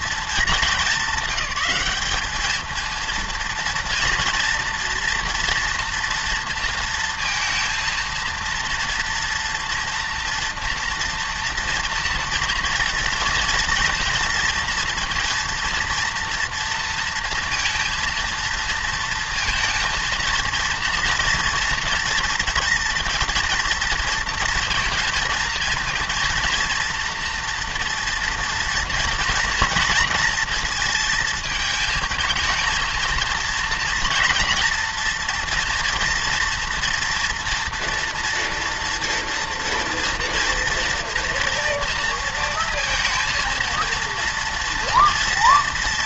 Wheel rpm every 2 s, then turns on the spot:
210, 220, 240, 230, 230, 230, 240, 230, 230, 230, 230, 230, 230, 230, 230, 230, 220, 230, 240, 230, 230, 230, 230.
none